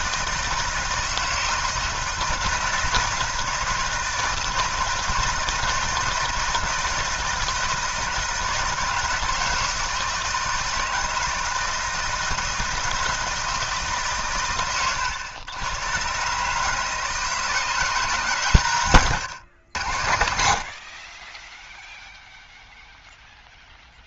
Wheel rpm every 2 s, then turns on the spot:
160, 160, 160, 160, 160, 160, 160, 120, 140, 140, 60, 0.
none